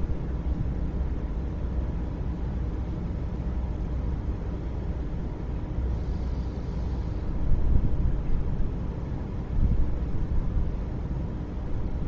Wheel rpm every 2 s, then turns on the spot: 0, 0, 0, 0, 0, 0.
none